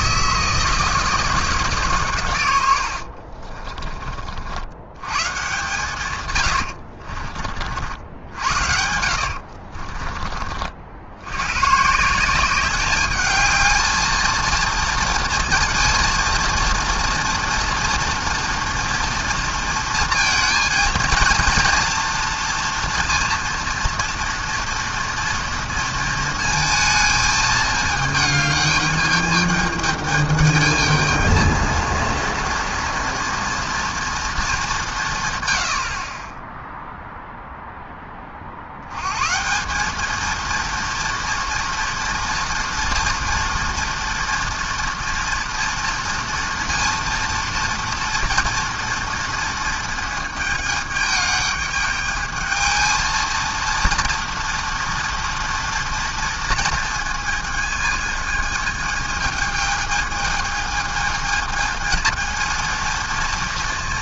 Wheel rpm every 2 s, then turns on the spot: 160, 80, 100, 70, 70, 60, 200, 230, 230, 230, 230, 230, 230, 220, 210, 220, 230, 190, 0, 100, 230, 230, 230, 230, 230, 210, 220, 230, 230, 220, 220, 230.
2-4 6-10